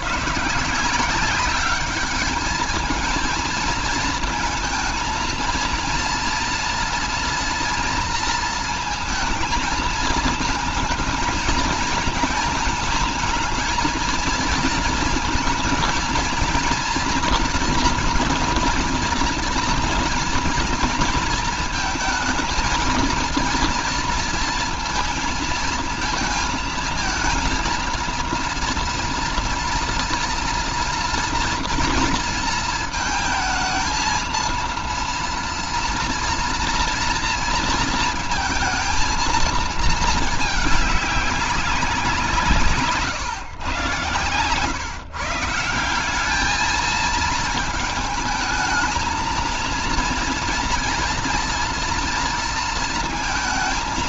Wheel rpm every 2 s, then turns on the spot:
160, 220, 220, 240, 230, 220, 220, 230, 230, 240, 230, 220, 230, 230, 230, 240, 220, 230, 230, 230, 210, 150, 140, 220, 220, 230, 230.
none